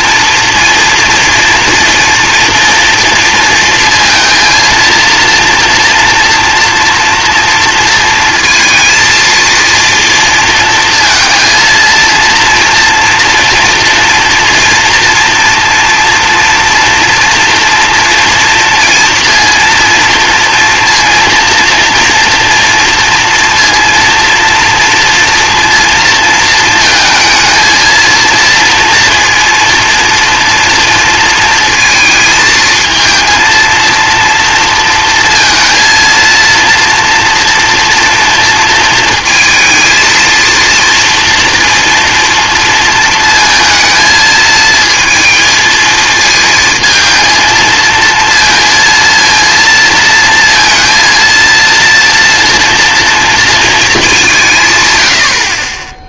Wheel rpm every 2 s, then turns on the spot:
240, 230, 230, 240, 230, 230, 230, 230, 230, 240, 230, 230, 230, 220, 230, 230, 220, 230, 230, 230, 230, 230, 220, 230, 230, 230, 230, 130.
none